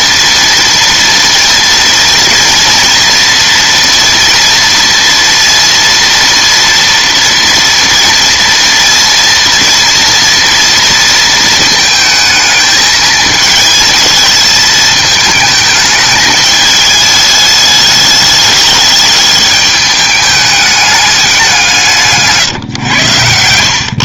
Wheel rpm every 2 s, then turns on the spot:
230, 230, 230, 230, 230, 230, 220, 220, 210, 210, 210, 140.
none